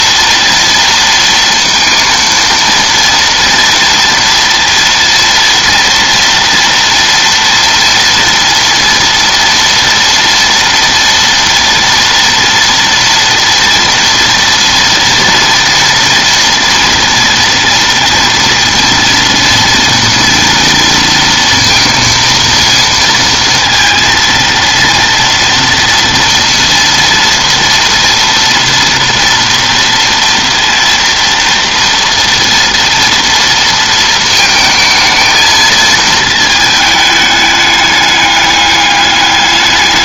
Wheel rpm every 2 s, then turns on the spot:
230, 230, 230, 230, 230, 230, 230, 240, 230, 230, 230, 230, 230, 230, 230, 230, 230, 220, 220, 200.
none